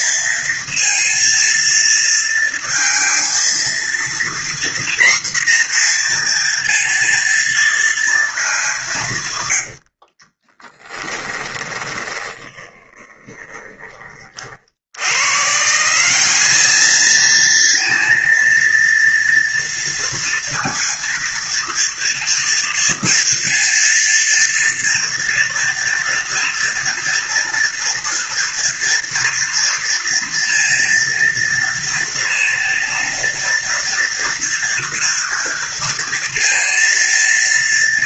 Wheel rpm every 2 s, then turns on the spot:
230, 230, 240, 240, 210, 20, 20, 50, 200, 230, 230, 230, 230, 230, 230, 230, 230, 230, 230.
10-14